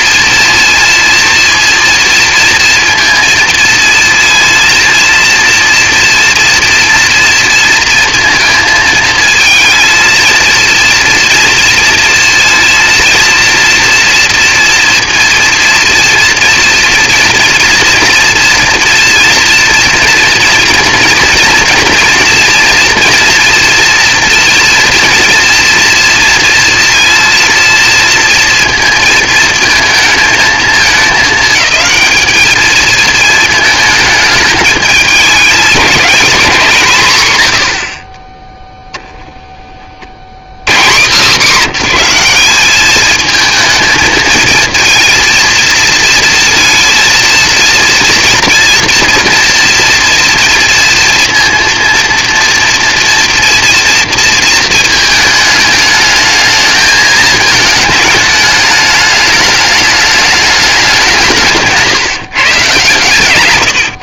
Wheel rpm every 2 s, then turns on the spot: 230, 230, 230, 230, 230, 230, 230, 230, 230, 230, 230, 230, 230, 230, 230, 220, 210, 220, 220, 50, 100, 190, 220, 230, 230, 240, 230, 230, 220, 210, 210, 140.
none